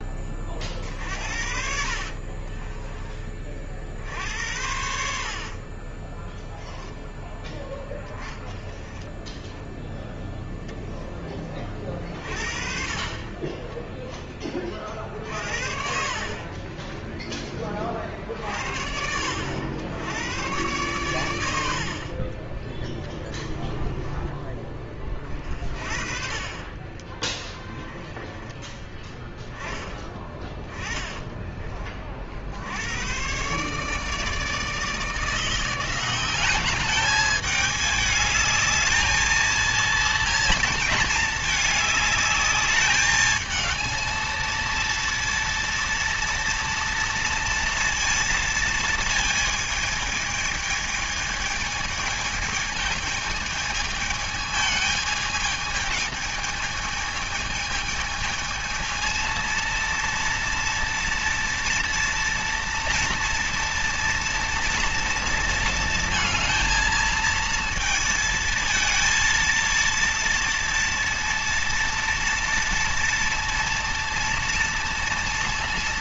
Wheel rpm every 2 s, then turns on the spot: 50, 30, 70, 10, 0, 10, 40, 40, 20, 60, 110, 20, 40, 30, 10, 20, 100, 160, 200, 220, 220, 210, 230, 230, 230, 220, 220, 210, 220, 230, 230, 240, 230, 230, 220, 230, 230, 230.
2-6 16-18 22-24 26-28 30-32